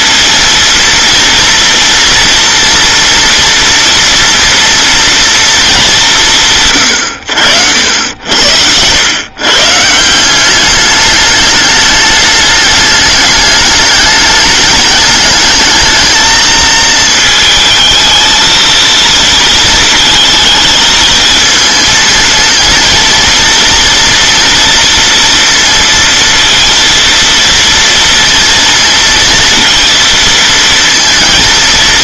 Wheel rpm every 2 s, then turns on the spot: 230, 240, 230, 140, 90, 200, 210, 210, 220, 230, 220, 230, 230, 230, 230, 230.
none